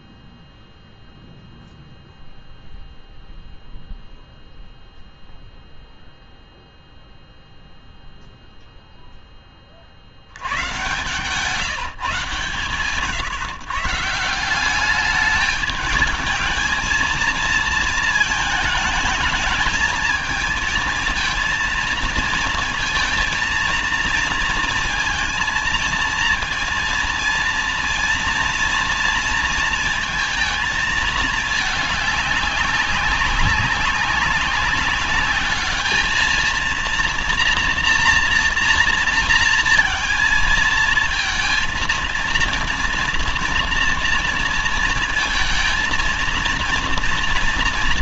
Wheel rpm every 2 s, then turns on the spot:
0, 0, 0, 0, 0, 90, 140, 180, 220, 220, 220, 230, 230, 230, 240, 220, 200, 200, 220, 230, 220, 230, 230, 230.
none